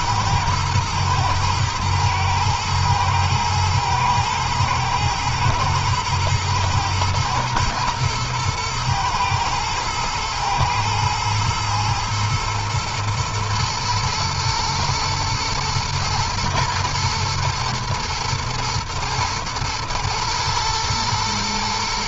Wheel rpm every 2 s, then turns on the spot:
120, 110, 110, 110, 110, 110, 120, 120, 120, 110, 110.
none